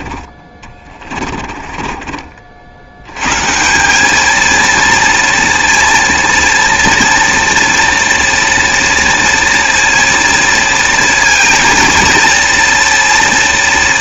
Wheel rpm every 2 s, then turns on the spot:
20, 60, 230, 230, 240, 230, 230.
0-2